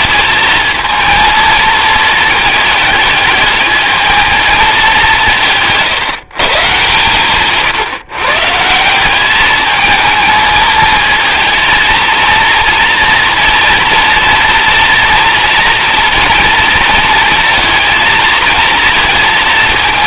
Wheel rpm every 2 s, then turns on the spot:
230, 210, 190, 130, 180, 220, 230, 230, 230, 220.
none